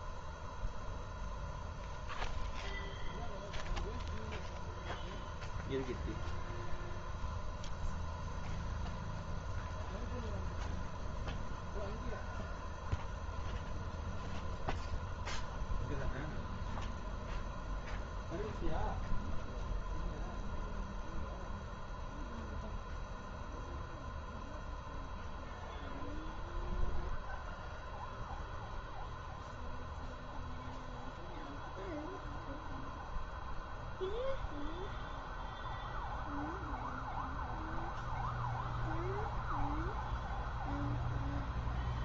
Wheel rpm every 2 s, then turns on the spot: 0, 0, 0, 0, 0, 0, 0, 0, 0, 0, 0, 0, 0, 0, 0, 0, 0, 0, 0, 0, 0.
none